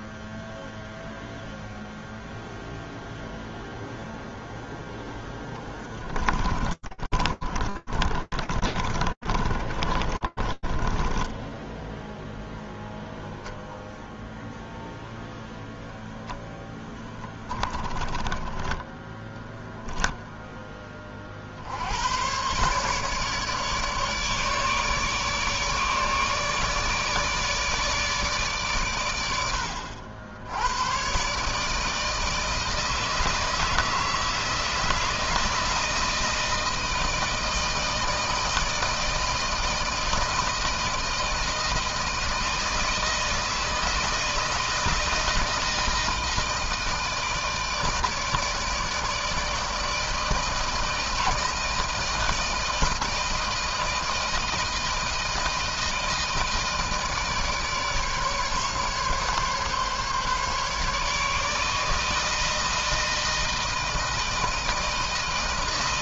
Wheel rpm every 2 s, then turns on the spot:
0, 0, 10, 30, 40, 10, 0, 0, 10, 10, 50, 150, 150, 150, 100, 140, 160, 160, 160, 160, 160, 160, 160, 160, 160, 160, 160, 160, 160, 150, 150, 160, 160.
4-12 16-20